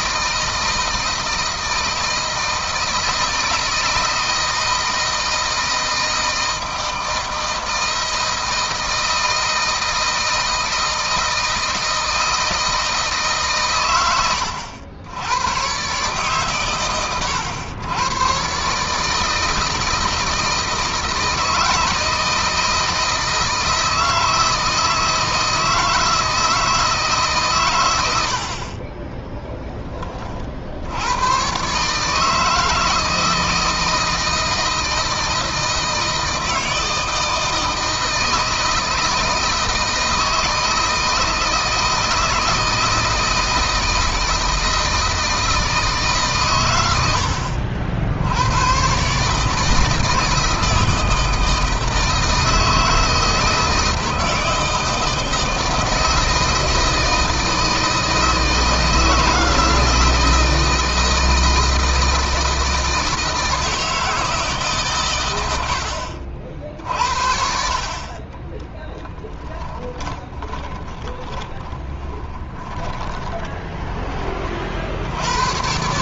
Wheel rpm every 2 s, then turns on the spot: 160, 160, 160, 160, 160, 160, 160, 90, 120, 150, 160, 160, 160, 160, 30, 80, 160, 160, 160, 160, 160, 160, 160, 110, 120, 160, 160, 160, 160, 160, 160, 160, 120, 50, 10, 20, 20, 70.
28-30 68-74